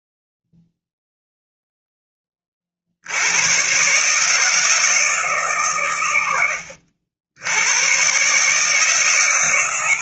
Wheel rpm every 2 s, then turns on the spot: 0, 70, 160, 80, 150.
none